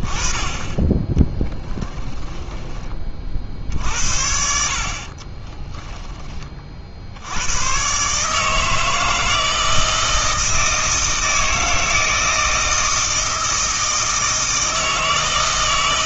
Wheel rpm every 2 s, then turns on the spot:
10, 20, 50, 50, 160, 160, 160, 160.
none